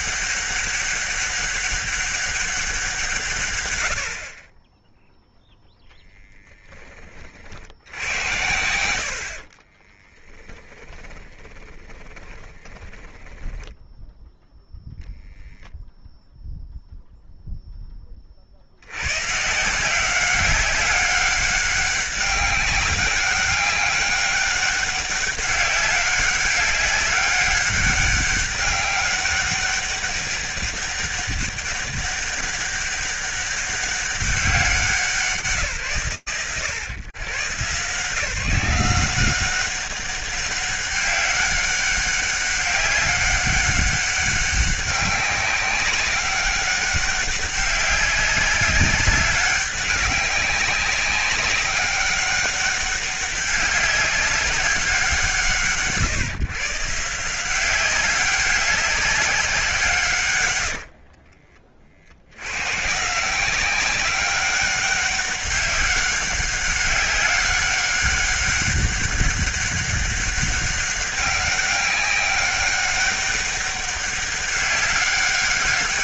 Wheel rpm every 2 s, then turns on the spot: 200, 190, 30, 10, 90, 10, 20, 0, 0, 60, 190, 200, 200, 200, 200, 200, 200, 190, 120, 160, 200, 200, 190, 200, 200, 200, 200, 200, 150, 190, 100, 110, 200, 200, 200, 200, 200, 200.
10-14 60-62